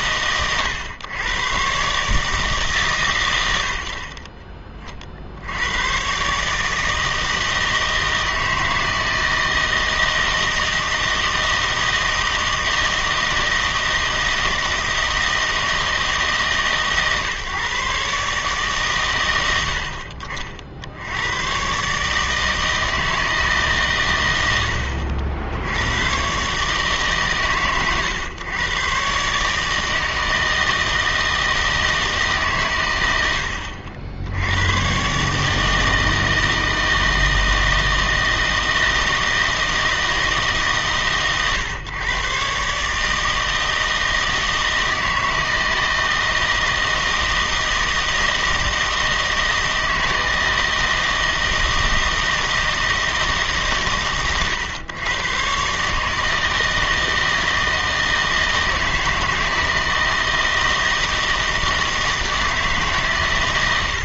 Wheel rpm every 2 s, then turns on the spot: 120, 140, 40, 150, 160, 160, 160, 160, 150, 130, 70, 160, 80, 140, 120, 160, 110, 110, 160, 160, 150, 140, 160, 160, 160, 160, 160, 120, 160, 160, 160, 150.
none